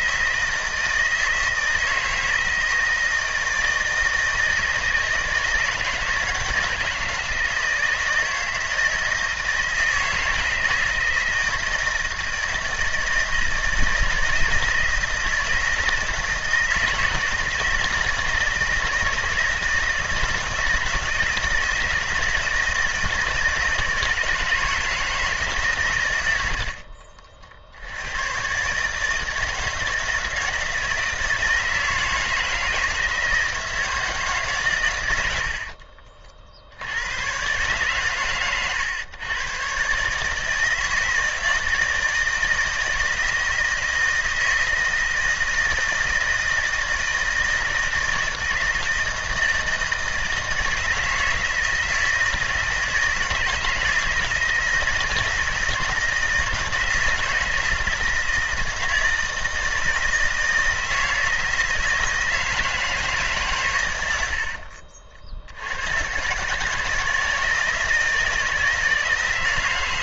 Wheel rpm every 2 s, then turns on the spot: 160, 160, 160, 160, 160, 160, 160, 160, 160, 160, 160, 160, 170, 80, 130, 160, 160, 130, 70, 110, 160, 160, 160, 160, 160, 160, 160, 160, 160, 160, 160, 160, 60, 140, 170.
26-28 64-66